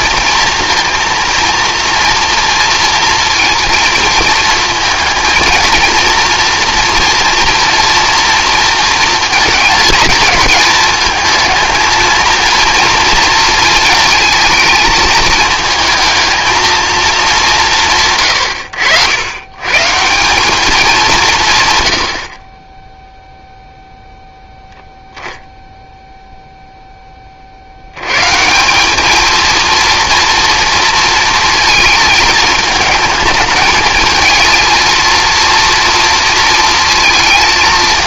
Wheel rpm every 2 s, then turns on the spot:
230, 230, 220, 240, 230, 220, 230, 220, 230, 100, 210, 20, 0, 0, 180, 230, 220, 230, 220.
none